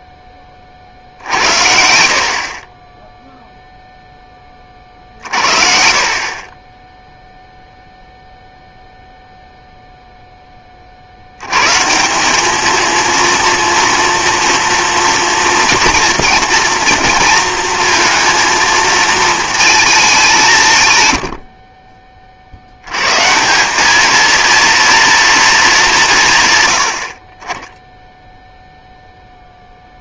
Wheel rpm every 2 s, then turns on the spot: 40, 20, 30, 0, 0, 20, 220, 230, 240, 230, 200, 90, 230, 80, 0.
none